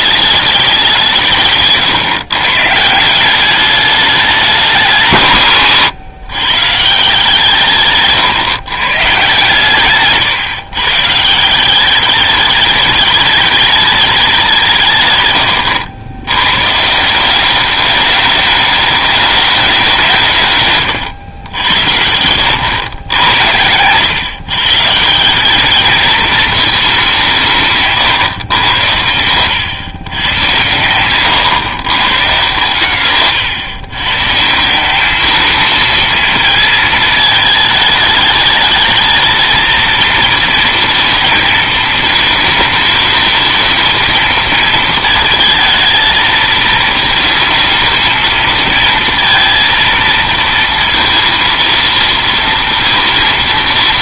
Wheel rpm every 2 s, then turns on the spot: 200, 140, 180, 140, 130, 130, 210, 170, 130, 210, 150, 90, 130, 220, 120, 120, 130, 160, 220, 220, 230, 220, 230, 220, 230, 230, 230.
none